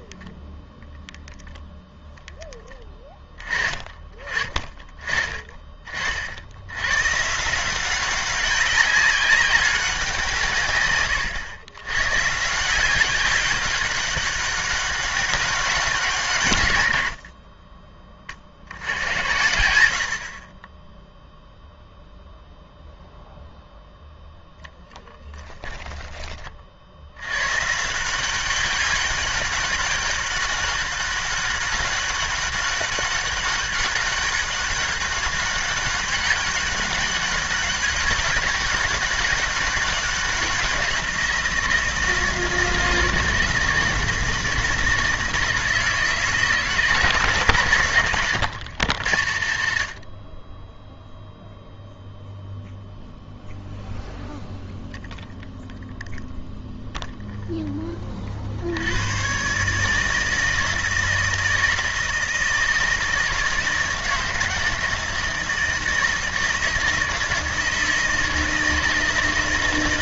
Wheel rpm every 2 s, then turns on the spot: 0, 10, 30, 90, 190, 140, 160, 200, 130, 70, 30, 0, 0, 50, 190, 190, 200, 200, 200, 200, 190, 160, 160, 150, 120, 20, 0, 0, 0, 70, 160, 160, 160, 160, 160.
none